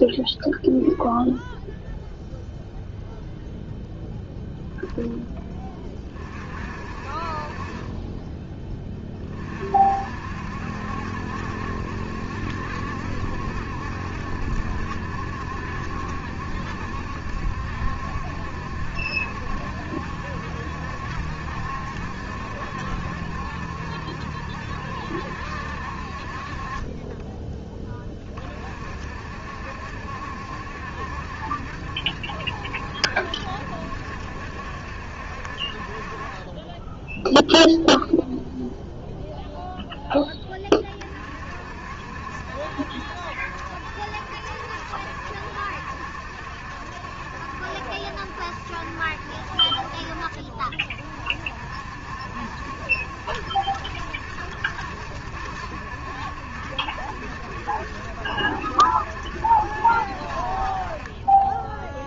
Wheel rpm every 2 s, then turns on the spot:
0, 0, 0, 40, 20, 60, 70, 70, 70, 70, 70, 70, 70, 40, 40, 70, 70, 70, 20, 0, 20, 70, 70, 70, 70, 50, 70, 70, 70, 70, 50.
none